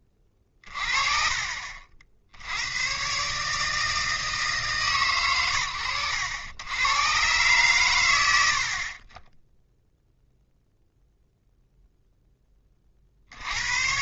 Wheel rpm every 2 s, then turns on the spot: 20, 90, 160, 90, 20, 0, 40.
none